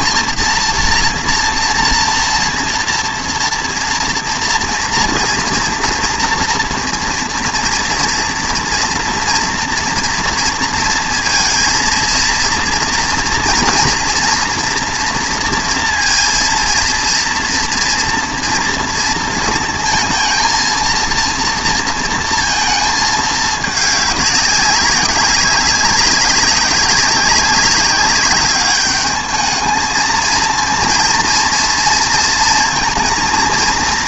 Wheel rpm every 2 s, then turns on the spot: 230, 230, 230, 230, 230, 230, 230, 230, 230, 230, 230, 220, 200, 200, 210, 230, 230.
none